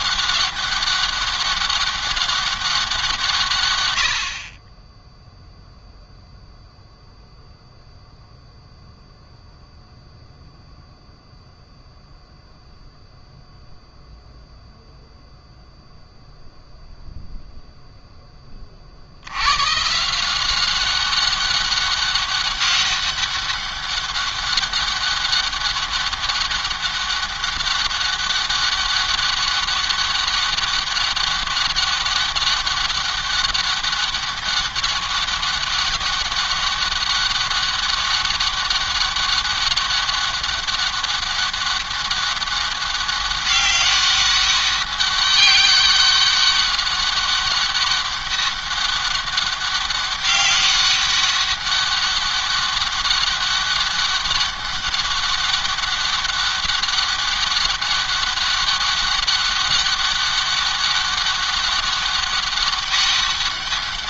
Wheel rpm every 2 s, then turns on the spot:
200, 190, 40, 0, 0, 0, 0, 0, 0, 20, 180, 200, 200, 200, 200, 200, 200, 200, 200, 200, 200, 200, 200, 200, 200, 200, 200, 200, 200, 200, 200, 200.
none